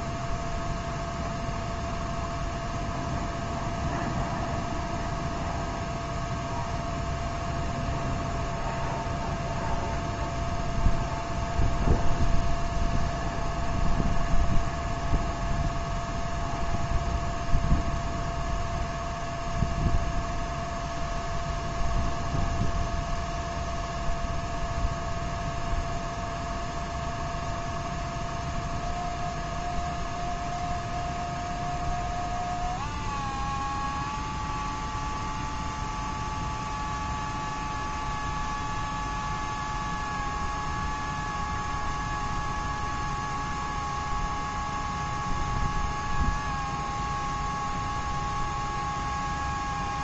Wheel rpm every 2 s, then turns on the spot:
0, 0, 0, 0, 0, 0, 0, 0, 0, 0, 0, 0, 0, 0, 0, 0, 0, 0, 0, 0, 0, 0, 0, 0, 0.
none